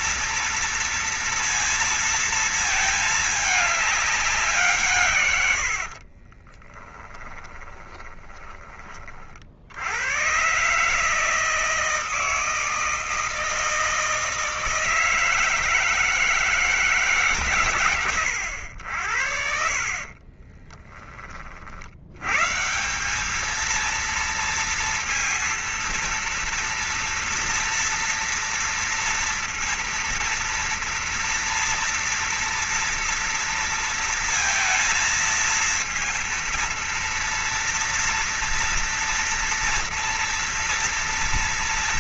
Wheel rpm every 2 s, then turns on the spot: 240, 230, 200, 50, 20, 100, 160, 160, 160, 110, 40, 90, 230, 230, 230, 230, 240, 230, 230, 230, 230.
6-10 20-22